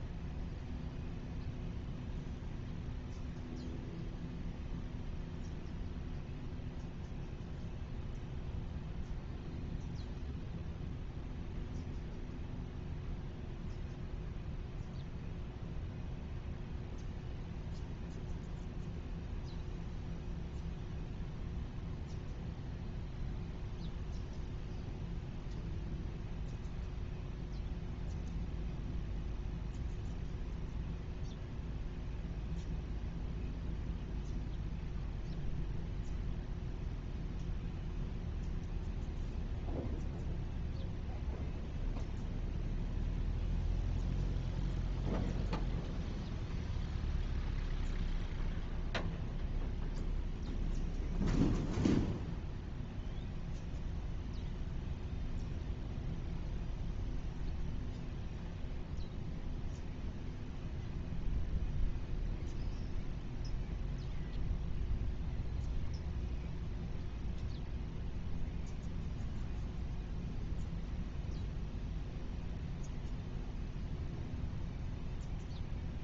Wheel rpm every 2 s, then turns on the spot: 0, 0, 0, 0, 0, 0, 0, 0, 0, 0, 0, 0, 0, 0, 0, 0, 0, 0, 0, 0, 0, 0, 0, 0, 0, 0, 0, 0, 0, 0, 0, 0, 0, 0, 0, 0, 0, 0.
none